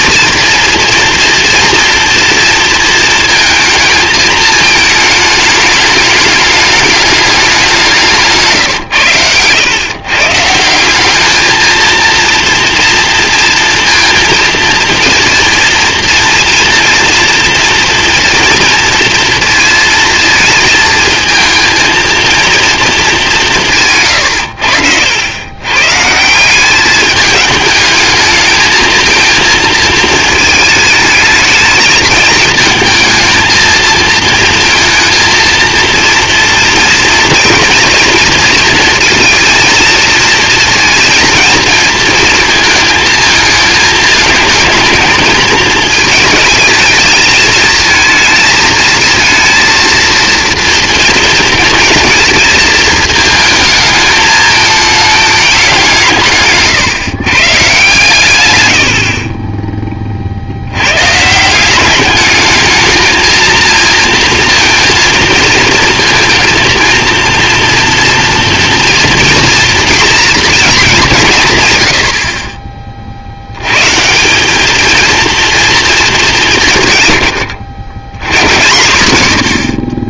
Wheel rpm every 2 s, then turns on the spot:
230, 220, 220, 210, 140, 170, 230, 230, 230, 230, 220, 220, 80, 190, 220, 220, 220, 230, 230, 230, 230, 230, 220, 220, 220, 240, 220, 210, 140, 120, 90, 220, 230, 230, 230, 220, 30, 210, 160, 100.
none